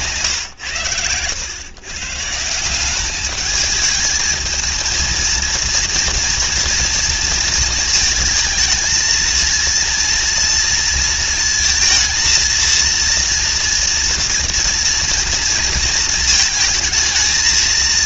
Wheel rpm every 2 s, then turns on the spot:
110, 200, 230, 230, 230, 220, 230, 230, 220.
0-2